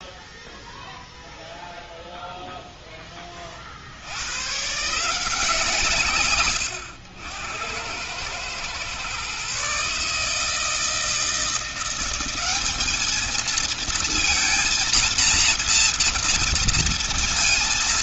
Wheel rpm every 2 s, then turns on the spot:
0, 0, 140, 90, 120, 160, 210, 230, 230.
none